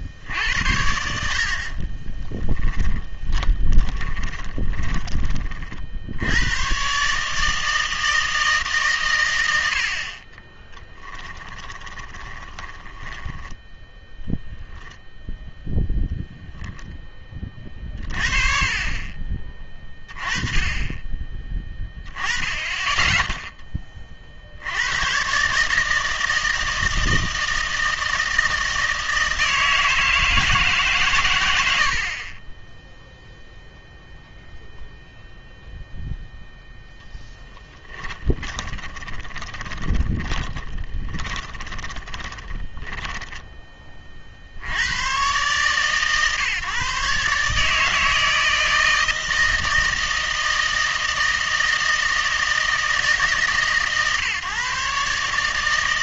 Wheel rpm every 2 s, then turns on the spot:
70, 20, 20, 120, 140, 10, 10, 0, 0, 30, 20, 10, 90, 160, 160, 150, 10, 0, 0, 20, 10, 10, 70, 140, 160, 160, 160, 140.
2-6 10-14 38-44